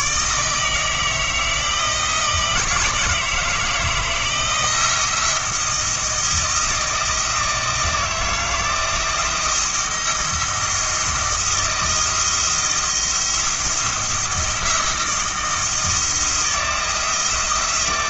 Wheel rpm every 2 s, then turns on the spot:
150, 160, 160, 160, 160, 160, 170, 170, 170.
none